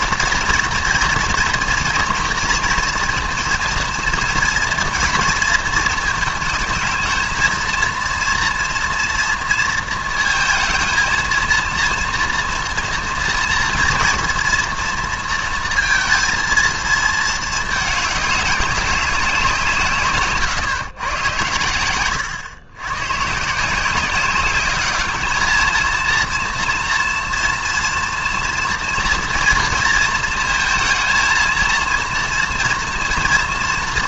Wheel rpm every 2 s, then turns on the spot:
230, 230, 240, 220, 240, 230, 240, 240, 220, 200, 140, 110, 200, 230, 230, 220, 230.
none